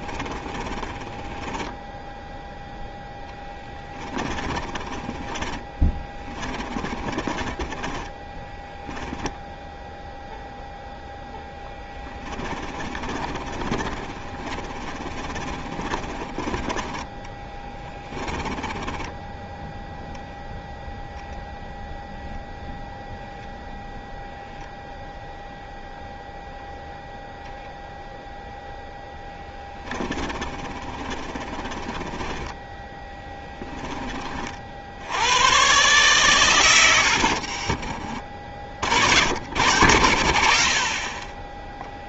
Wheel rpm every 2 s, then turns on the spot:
20, 0, 30, 20, 10, 0, 20, 30, 30, 10, 0, 0, 0, 0, 0, 30, 20, 60, 110, 50, 60.
0-2 4-10 12-16 18-20 30-34